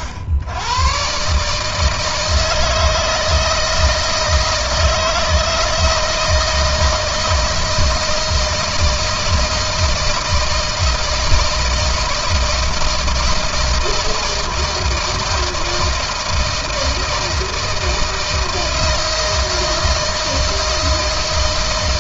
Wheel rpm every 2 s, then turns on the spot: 100, 160, 160, 160, 160, 160, 160, 160, 160, 160, 160.
none